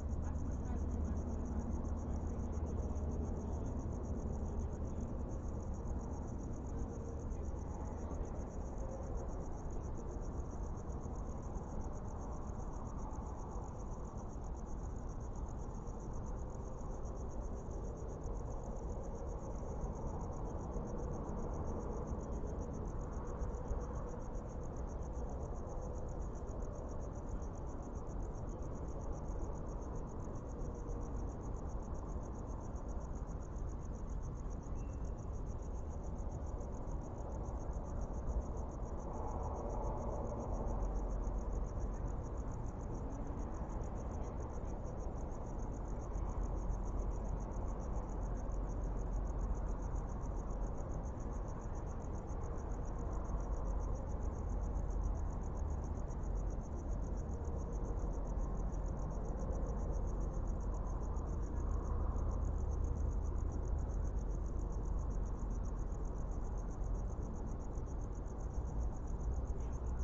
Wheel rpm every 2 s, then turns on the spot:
0, 0, 0, 0, 0, 0, 0, 0, 0, 0, 0, 0, 0, 0, 0, 0, 0, 0, 0, 0, 0, 0, 0, 0, 0, 0, 0, 0, 0, 0, 0, 0, 0, 0, 0.
none